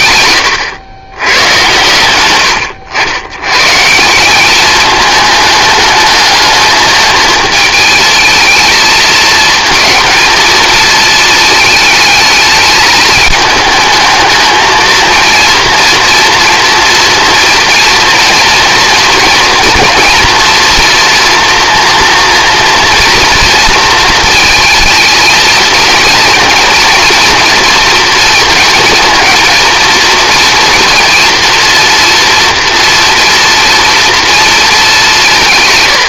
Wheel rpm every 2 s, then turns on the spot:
110, 90, 210, 220, 220, 230, 220, 230, 230, 230, 240, 230, 220, 230, 230, 230, 230, 220.
none